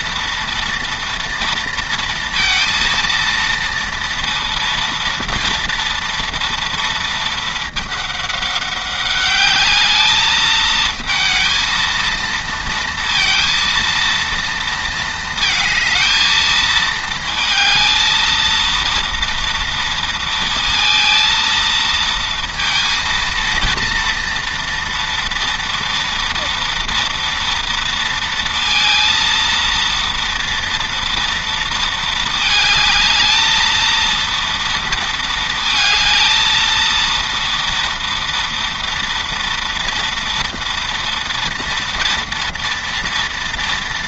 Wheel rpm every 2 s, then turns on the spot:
230, 230, 230, 220, 200, 220, 230, 220, 220, 240, 230, 230, 230, 240, 230, 230, 220, 230, 230, 230, 230, 230.
none